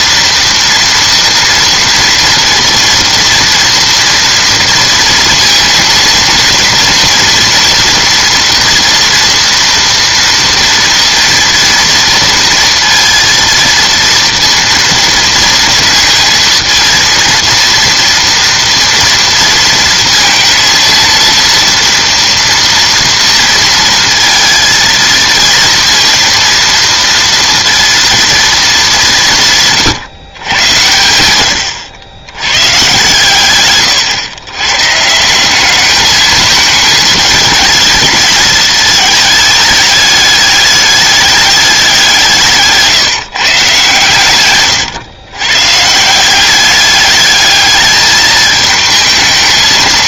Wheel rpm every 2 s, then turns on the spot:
230, 230, 230, 230, 230, 240, 230, 230, 230, 230, 230, 230, 230, 230, 210, 100, 120, 130, 210, 220, 210, 160, 120, 200, 220.
none